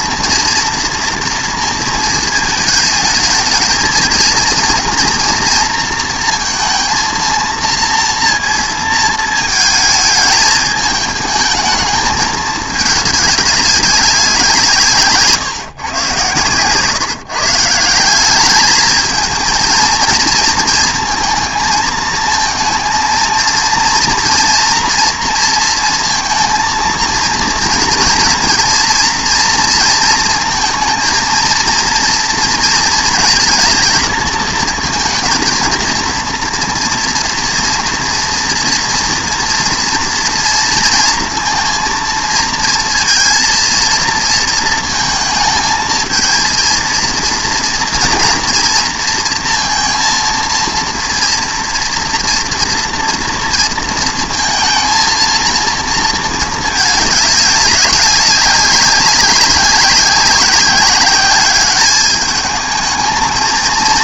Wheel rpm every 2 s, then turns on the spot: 230, 220, 230, 230, 230, 210, 210, 150, 140, 210, 230, 230, 240, 230, 230, 230, 230, 220, 230, 230, 230, 230, 230, 230, 230, 230, 230, 230, 210, 190, 190, 220.
none